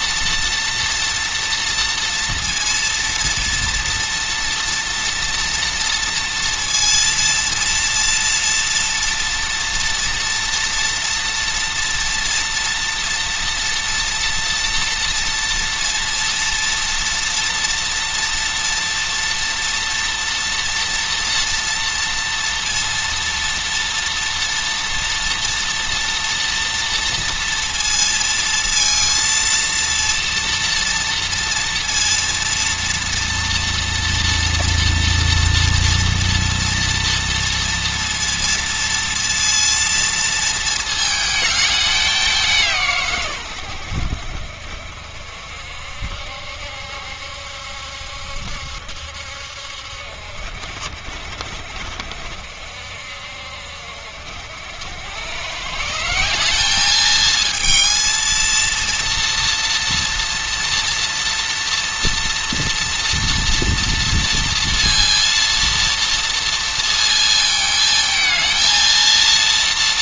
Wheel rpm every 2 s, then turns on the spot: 230, 230, 230, 230, 230, 230, 230, 240, 230, 230, 230, 230, 230, 230, 230, 230, 240, 230, 230, 230, 220, 140, 60, 70, 70, 70, 70, 100, 210, 230, 230, 230, 230, 230, 230.
none